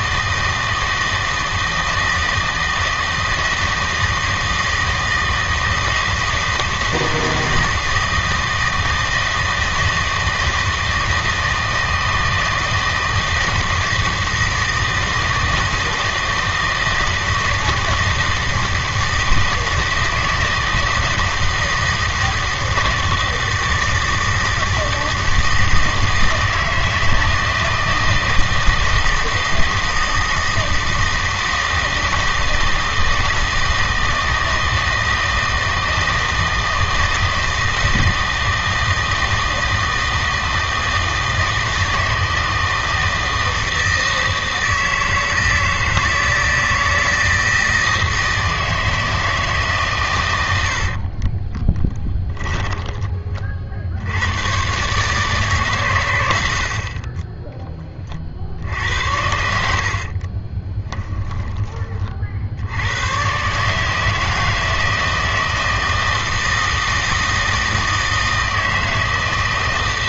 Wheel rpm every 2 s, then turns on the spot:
160, 160, 160, 160, 160, 160, 160, 160, 160, 160, 160, 160, 160, 160, 160, 160, 160, 160, 160, 160, 160, 160, 160, 160, 160, 70, 20, 120, 70, 70, 20, 80, 160, 160, 160.
50-54 60-62